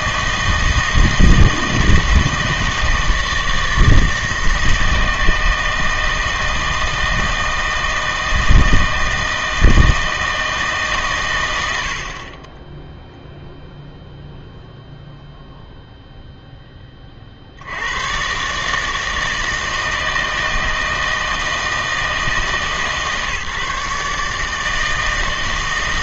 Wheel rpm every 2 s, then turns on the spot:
160, 160, 160, 160, 160, 150, 10, 0, 10, 150, 160, 150, 160.
none